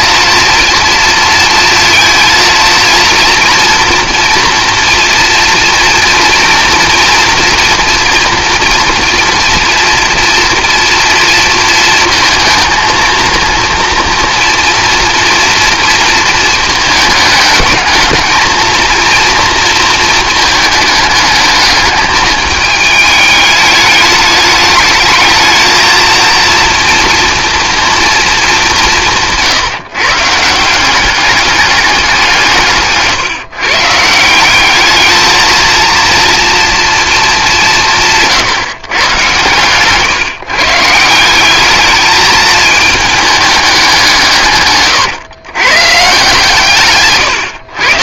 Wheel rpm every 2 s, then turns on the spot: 230, 230, 230, 230, 230, 230, 230, 230, 220, 230, 220, 210, 210, 230, 180, 190, 150, 200, 230, 130, 150, 220, 130, 140.
none